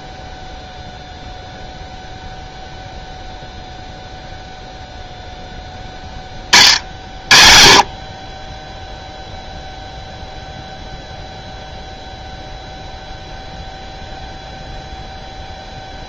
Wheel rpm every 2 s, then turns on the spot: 0, 0, 0, 50, 10, 0, 0, 0.
none